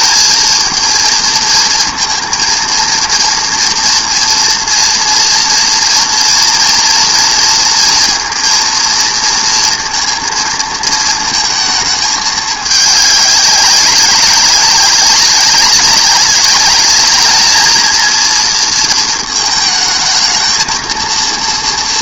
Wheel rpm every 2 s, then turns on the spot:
220, 230, 230, 230, 230, 230, 210, 190, 200, 230, 230.
none